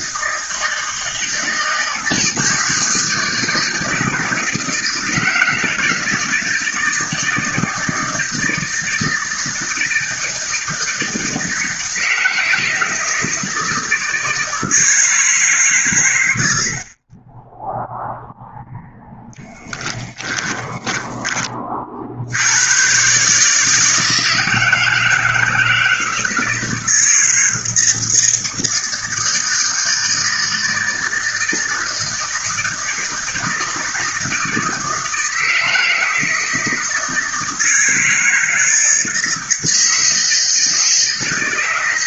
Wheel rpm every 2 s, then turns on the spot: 160, 160, 160, 160, 160, 160, 160, 160, 50, 0, 10, 120, 160, 160, 160, 160, 160, 160, 160, 160, 160.
20-22